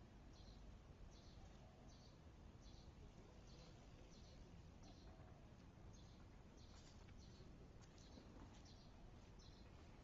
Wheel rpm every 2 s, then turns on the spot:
0, 0, 0, 0, 0.
none